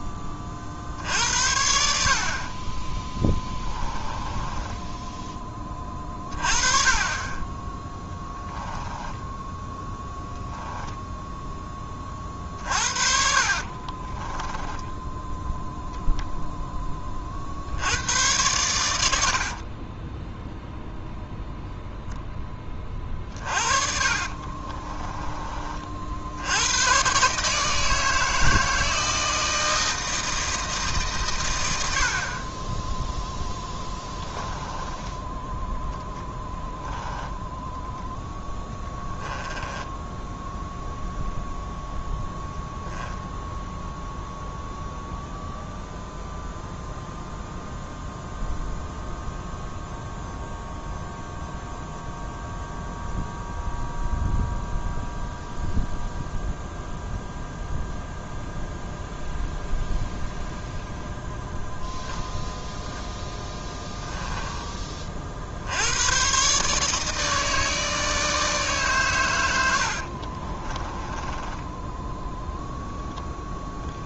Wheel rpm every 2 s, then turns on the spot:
30, 20, 10, 30, 10, 0, 50, 10, 10, 100, 0, 20, 30, 100, 160, 160, 10, 10, 10, 10, 0, 0, 0, 0, 0, 0, 0, 0, 0, 0, 0, 10, 20, 150, 140, 20, 0.
4-6 8-10 12-16 22-26 34-40 70-72